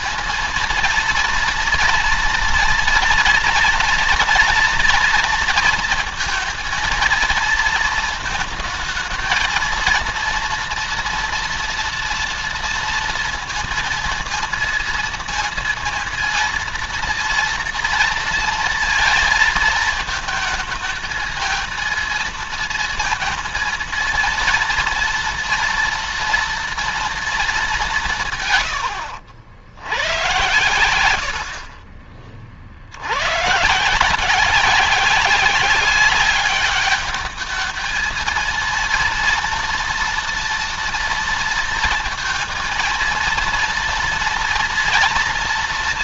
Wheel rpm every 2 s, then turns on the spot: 230, 240, 240, 230, 220, 230, 230, 230, 230, 230, 220, 230, 230, 230, 130, 110, 50, 180, 200, 230, 230, 230, 230.
none